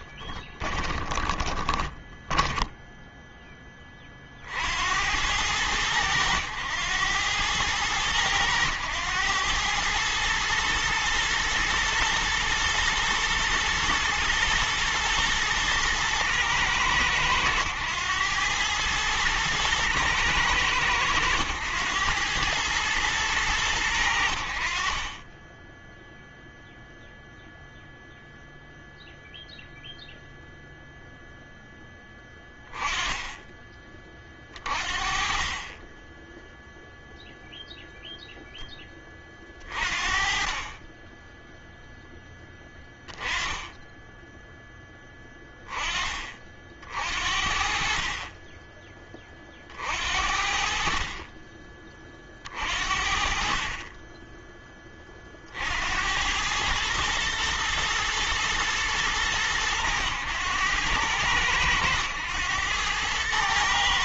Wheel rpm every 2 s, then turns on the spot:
10, 10, 50, 100, 100, 110, 110, 110, 110, 110, 110, 110, 60, 0, 0, 0, 10, 40, 10, 0, 30, 0, 10, 40, 30, 60, 40, 10, 100, 110, 100, 100.
0-4